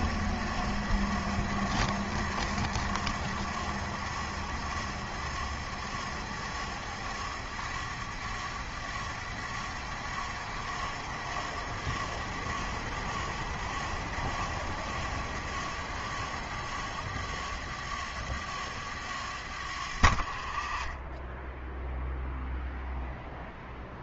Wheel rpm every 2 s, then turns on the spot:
50, 50, 50, 50, 50, 50, 50, 50, 50, 50, 30, 0.
none